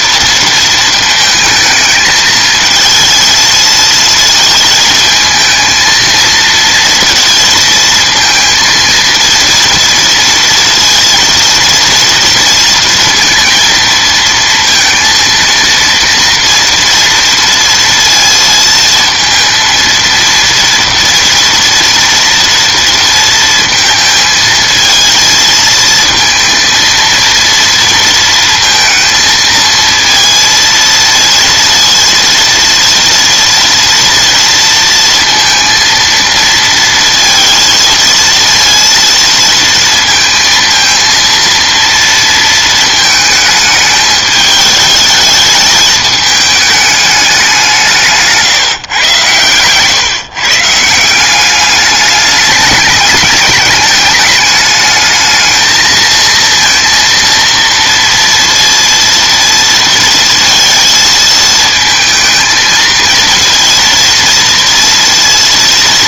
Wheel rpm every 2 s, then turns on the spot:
230, 220, 220, 230, 230, 230, 230, 230, 230, 230, 230, 230, 230, 230, 230, 230, 230, 230, 230, 230, 230, 230, 210, 210, 130, 160, 210, 210, 230, 230, 230, 230, 230.
none